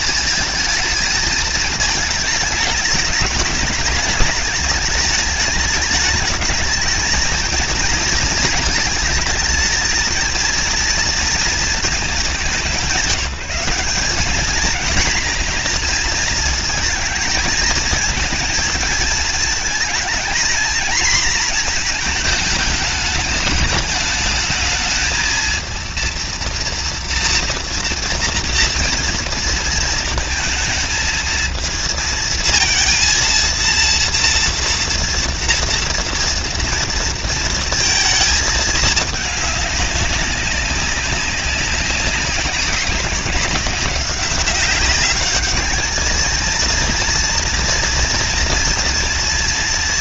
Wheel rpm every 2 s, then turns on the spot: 220, 220, 210, 210, 230, 220, 230, 190, 230, 220, 220, 230, 210, 220, 230, 230, 230, 230, 230, 230, 210, 190, 190, 200, 230.
none